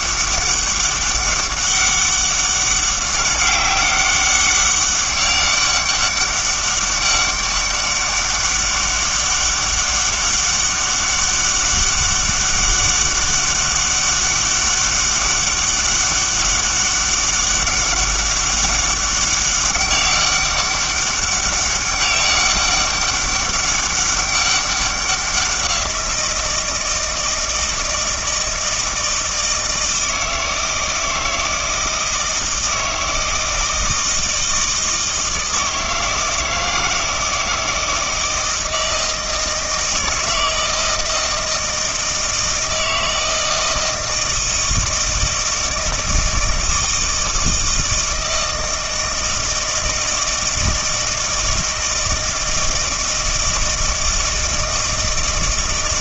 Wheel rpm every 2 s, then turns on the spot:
200, 200, 200, 200, 200, 200, 200, 200, 200, 200, 200, 200, 190, 160, 160, 160, 160, 160, 160, 160, 160, 160, 160, 160, 160, 160, 160, 160.
none